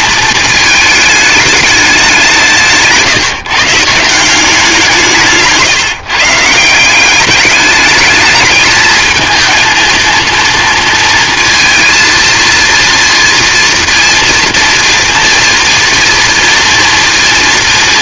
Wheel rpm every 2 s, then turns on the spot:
220, 180, 180, 170, 220, 230, 230, 230, 230.
none